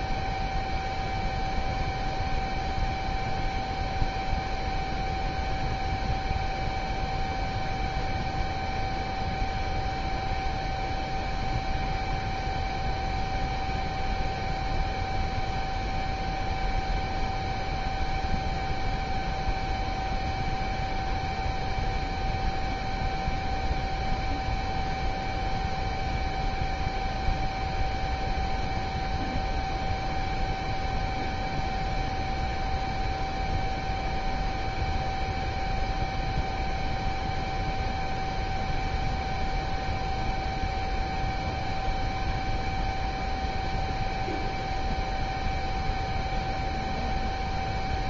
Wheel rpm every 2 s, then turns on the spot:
0, 0, 0, 0, 0, 0, 0, 0, 0, 0, 0, 0, 0, 0, 0, 0, 0, 0, 0, 0, 0, 0, 0, 0.
none